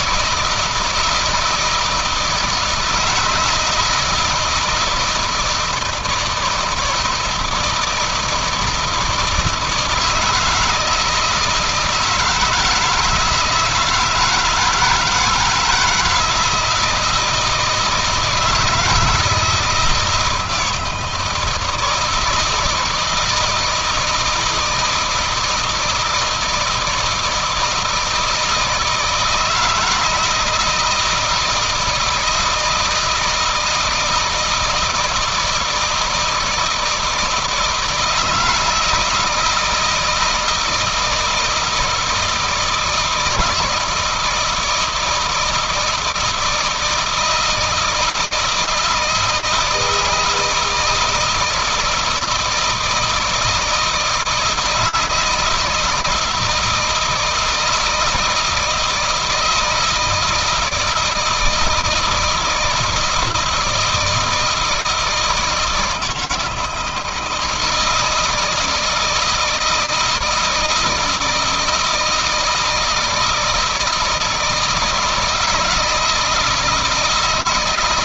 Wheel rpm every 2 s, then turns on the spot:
160, 160, 160, 160, 160, 160, 160, 160, 160, 160, 170, 160, 160, 160, 160, 160, 160, 160, 160, 160, 160, 160, 170, 160, 160, 160, 160, 160, 170, 160, 160, 160, 160, 160, 160, 160, 160, 160, 160.
none